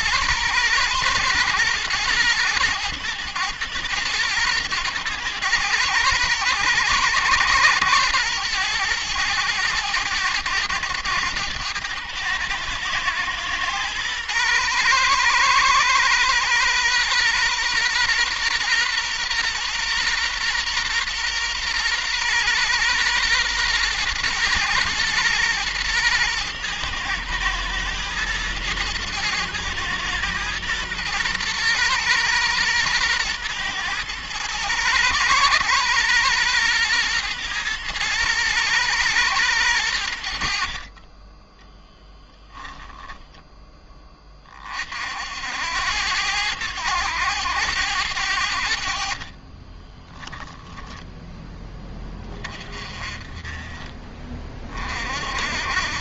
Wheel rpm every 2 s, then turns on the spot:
120, 110, 110, 110, 110, 100, 110, 120, 120, 120, 120, 120, 110, 110, 110, 120, 120, 120, 120, 110, 40, 10, 50, 100, 50, 10, 30, 40.
none